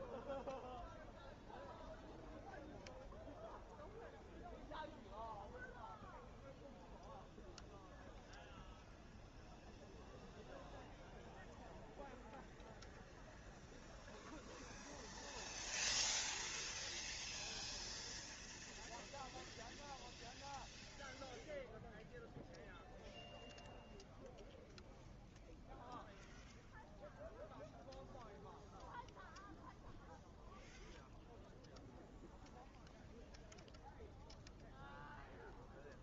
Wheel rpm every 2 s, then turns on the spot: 0, 0, 0, 0, 0, 0, 0, 0, 0, 0, 0, 0, 0, 0, 0, 0, 0, 0.
none